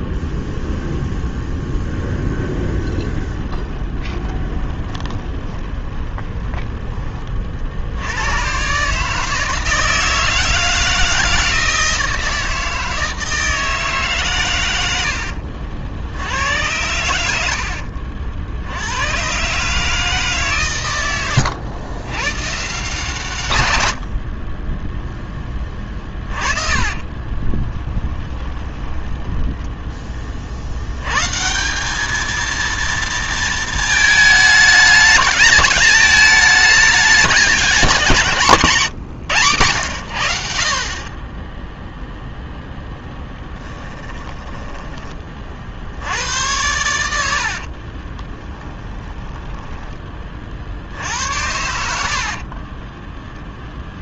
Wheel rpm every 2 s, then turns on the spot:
0, 20, 20, 20, 140, 160, 160, 90, 90, 100, 110, 140, 0, 30, 20, 100, 230, 210, 210, 150, 40, 0, 20, 90, 10, 60, 10.
2-6 26-30 46-50